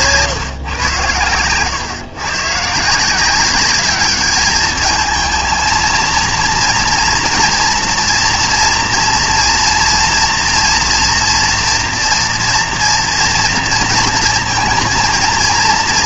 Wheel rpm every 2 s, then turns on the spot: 140, 130, 210, 230, 230, 230, 240, 230.
none